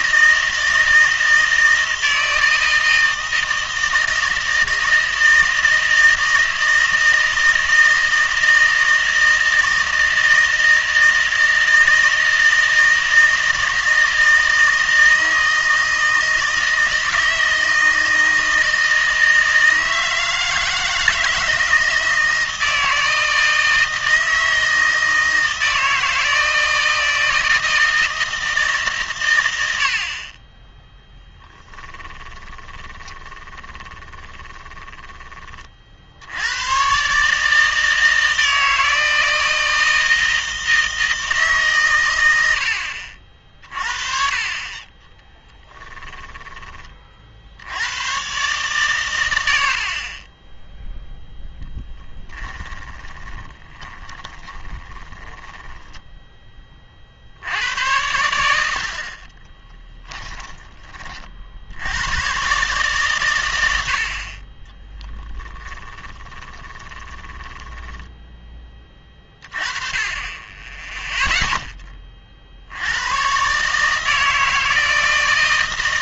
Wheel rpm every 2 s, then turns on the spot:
160, 160, 160, 160, 160, 160, 160, 160, 160, 160, 160, 160, 160, 160, 150, 10, 20, 10, 110, 160, 160, 80, 30, 20, 120, 0, 20, 20, 30, 80, 20, 130, 20, 20, 10, 10, 70, 160.
32-34 52-56 66-68